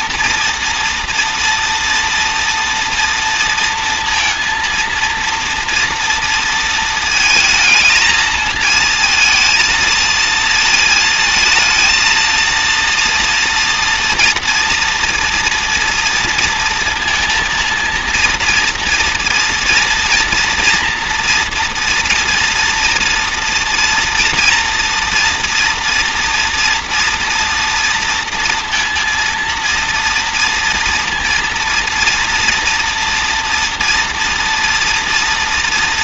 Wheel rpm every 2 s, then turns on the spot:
230, 230, 230, 230, 220, 230, 230, 230, 230, 230, 230, 230, 230, 230, 230, 230, 230, 230.
none